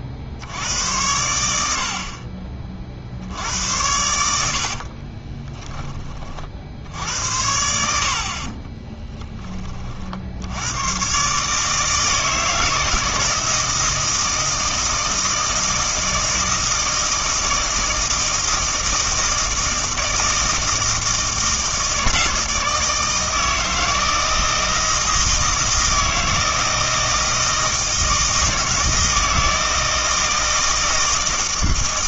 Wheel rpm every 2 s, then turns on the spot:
90, 40, 50, 60, 30, 90, 160, 160, 160, 160, 160, 160, 160, 160, 160, 160.
4-6 8-10